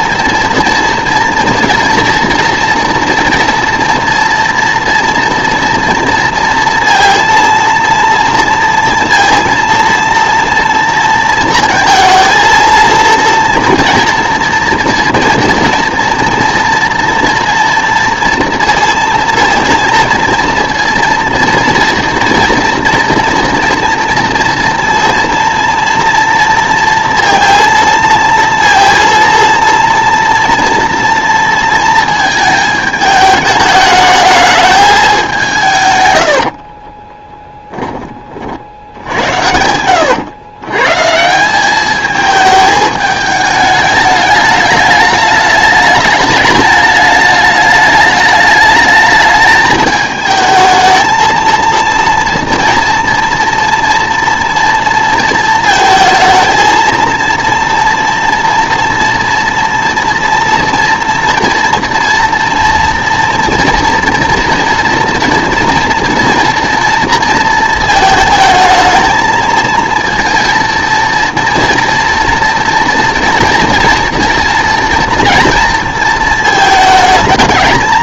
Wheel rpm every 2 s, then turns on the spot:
230, 240, 240, 230, 230, 230, 230, 240, 230, 230, 240, 240, 240, 230, 230, 230, 220, 210, 30, 60, 120, 210, 210, 210, 210, 220, 230, 230, 230, 230, 240, 230, 230, 230, 220, 230, 230, 230, 220.
36-38